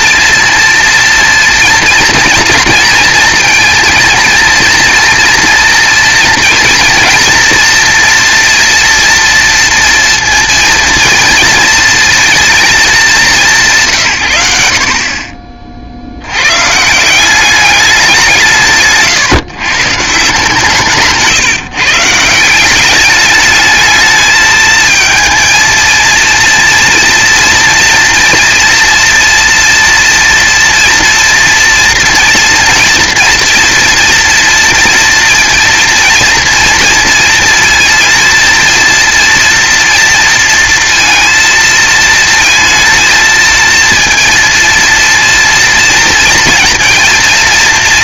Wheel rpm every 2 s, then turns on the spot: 230, 230, 230, 230, 230, 230, 200, 60, 150, 150, 160, 200, 220, 230, 240, 230, 240, 230, 230, 230, 230, 220, 230, 230.
20-22